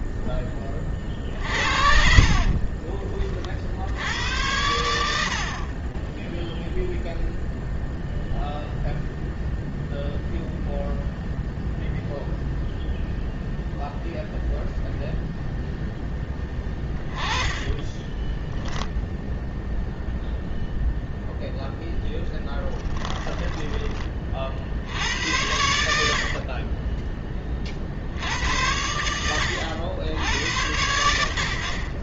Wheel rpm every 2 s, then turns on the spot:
30, 30, 90, 0, 0, 0, 0, 0, 20, 0, 0, 10, 90, 30, 90, 70.
2-4 16-18 22-24